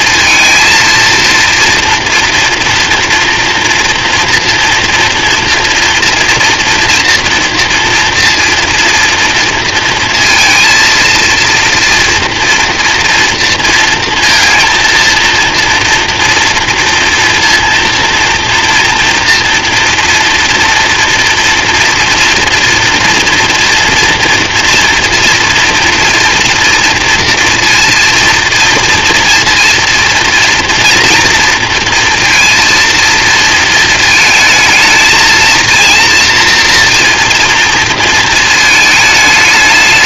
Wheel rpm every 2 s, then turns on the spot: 230, 240, 230, 240, 230, 230, 230, 230, 230, 230, 230, 230, 230, 230, 230, 230, 230, 220, 230, 220.
none